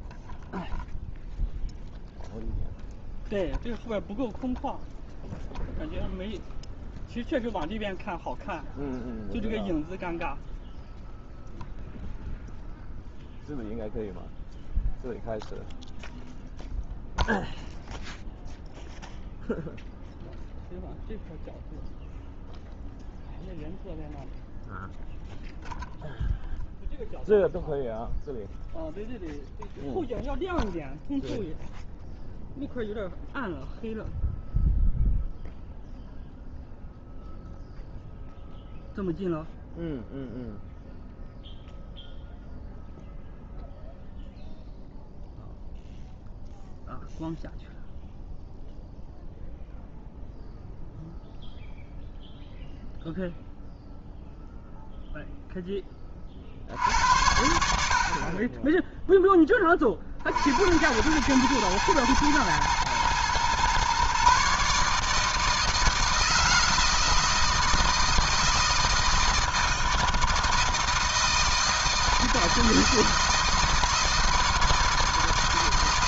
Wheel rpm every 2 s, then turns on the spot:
0, 0, 0, 0, 0, 0, 0, 0, 0, 0, 0, 0, 0, 0, 0, 0, 0, 0, 0, 0, 0, 0, 0, 0, 0, 0, 0, 0, 60, 20, 80, 110, 140, 160, 160, 160, 160, 160.
none